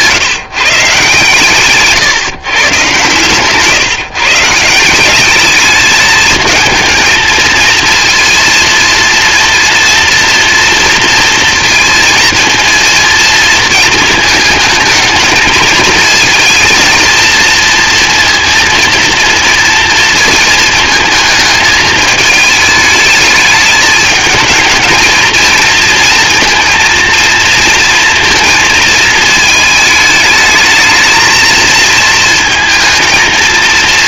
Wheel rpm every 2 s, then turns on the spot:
140, 120, 160, 220, 230, 230, 230, 220, 230, 230, 220, 210, 220, 230, 230, 220, 220.
none